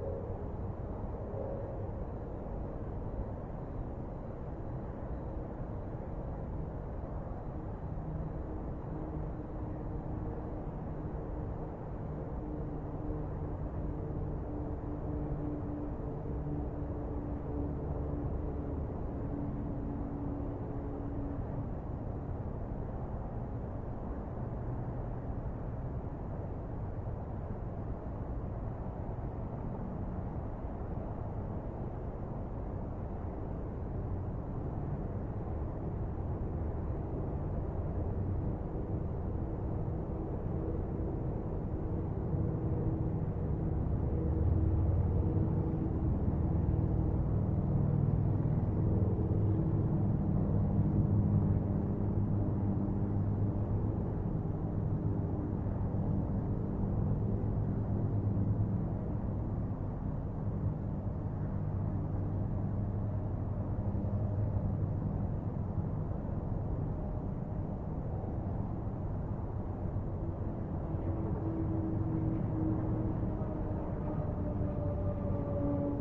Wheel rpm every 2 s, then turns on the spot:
0, 0, 0, 0, 0, 0, 0, 0, 0, 0, 0, 0, 0, 0, 0, 0, 0, 0, 0, 0, 0, 0, 0, 0, 0, 0, 0, 0, 0, 0, 0, 0, 0, 0, 0, 0, 0, 0.
none